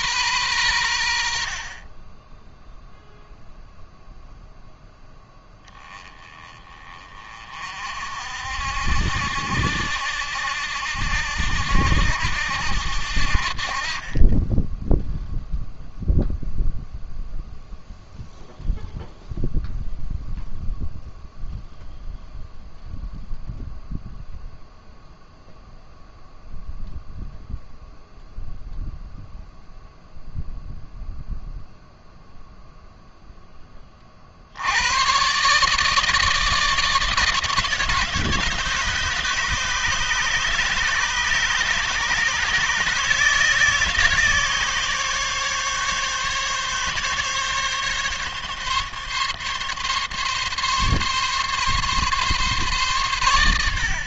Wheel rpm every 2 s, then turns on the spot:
110, 10, 0, 20, 60, 70, 70, 10, 0, 0, 0, 0, 0, 0, 0, 0, 0, 80, 160, 150, 150, 150, 150, 140, 140, 140, 140.
none